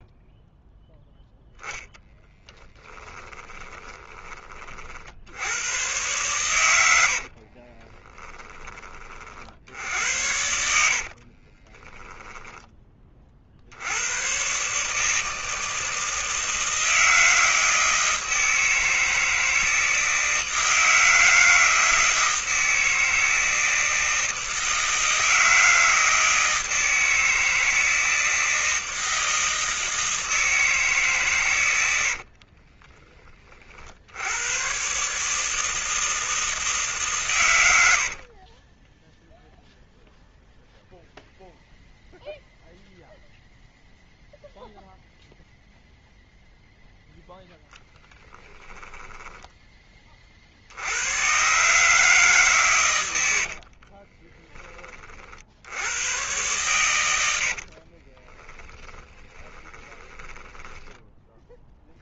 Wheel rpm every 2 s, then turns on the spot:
0, 10, 60, 90, 30, 70, 20, 150, 160, 160, 160, 160, 160, 160, 160, 150, 30, 130, 150, 20, 0, 0, 0, 0, 10, 80, 120, 30, 110, 10, 10.
2-4 6-8 10-12 32-34 38-40 48-50 56-62